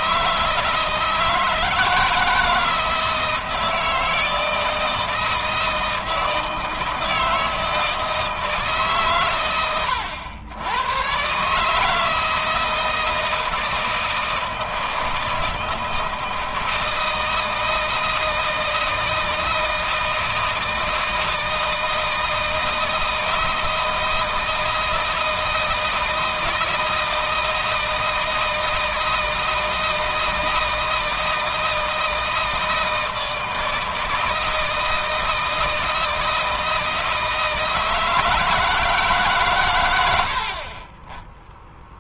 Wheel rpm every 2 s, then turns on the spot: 160, 160, 160, 160, 140, 110, 160, 160, 160, 160, 160, 160, 160, 160, 160, 160, 160, 160, 160, 160, 40.
none